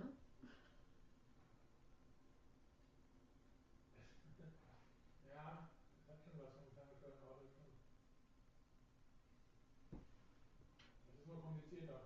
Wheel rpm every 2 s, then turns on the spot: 0, 0, 0, 0, 0, 0.
none